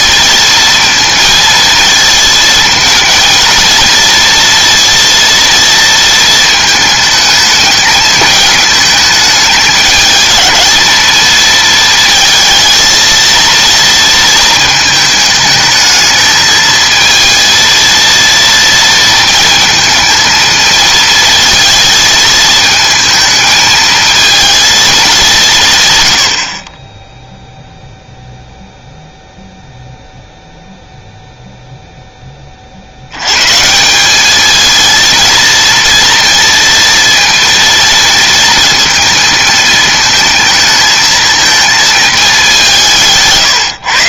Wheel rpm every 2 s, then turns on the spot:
230, 220, 230, 220, 220, 220, 230, 230, 220, 230, 220, 230, 230, 60, 0, 0, 40, 220, 230, 230, 220, 180.
none